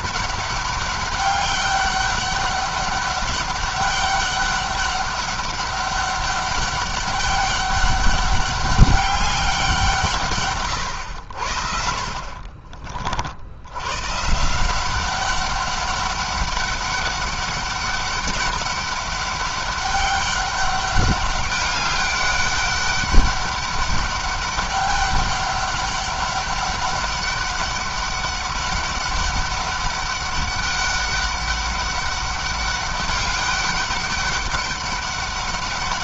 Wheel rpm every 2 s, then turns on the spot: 200, 200, 200, 200, 200, 110, 50, 180, 200, 200, 200, 200, 200, 200, 200, 200, 200, 200.
none